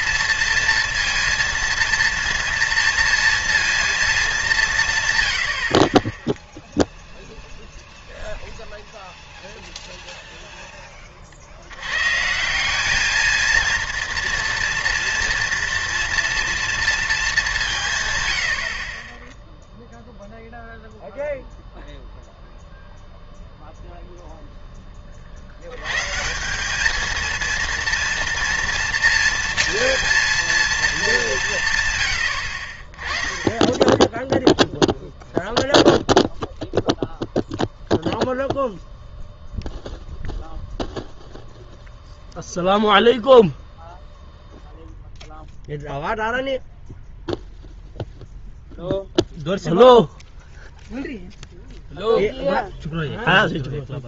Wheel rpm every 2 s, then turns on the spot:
230, 230, 170, 0, 0, 10, 190, 230, 230, 60, 0, 0, 10, 190, 230, 230, 60, 0, 0, 0, 0, 0, 0, 0, 0, 0, 0.
none